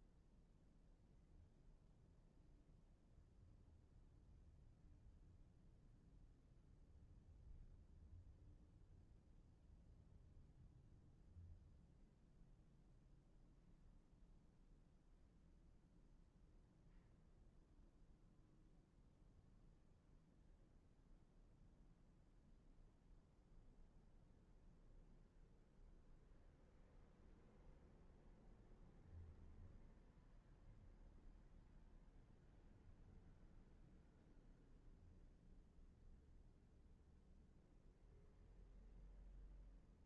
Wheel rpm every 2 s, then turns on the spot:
0, 0, 0, 0, 0, 0, 0, 0, 0, 0, 0, 0, 0, 0, 0, 0, 0, 0, 0, 0.
none